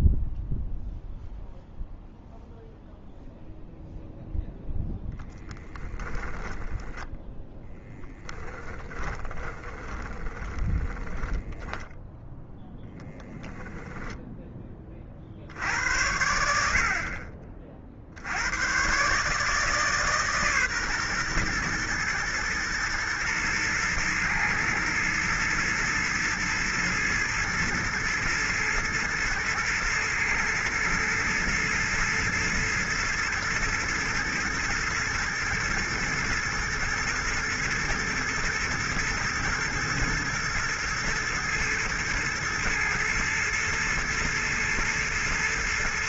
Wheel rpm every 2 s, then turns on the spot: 0, 0, 10, 10, 20, 20, 0, 20, 50, 120, 130, 120, 120, 110, 120, 120, 110, 110, 110, 120, 120, 110, 120.
6-12